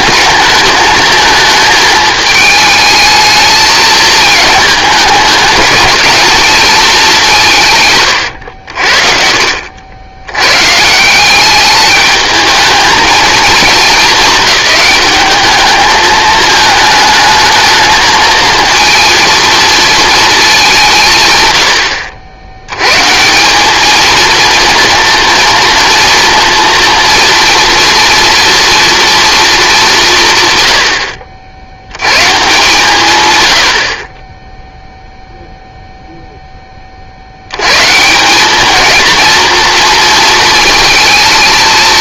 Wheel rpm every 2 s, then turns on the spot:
210, 220, 210, 220, 70, 140, 220, 210, 210, 230, 180, 120, 230, 230, 230, 110, 150, 0, 20, 220, 230.
none